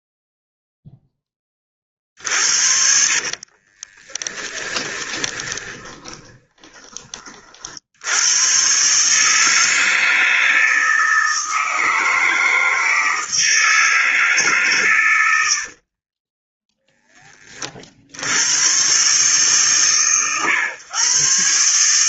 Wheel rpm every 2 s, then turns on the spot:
0, 50, 10, 20, 120, 160, 160, 150, 10, 110, 120.
2-8 16-18